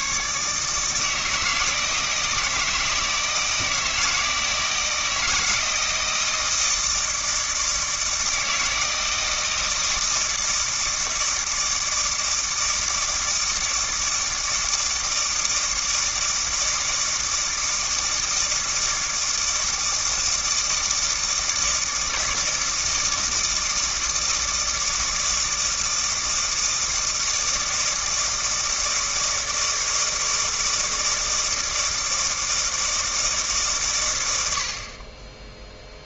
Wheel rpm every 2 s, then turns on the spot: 140, 160, 160, 160, 160, 160, 160, 160, 160, 160, 160, 160, 160, 160, 160, 160, 160, 80.
none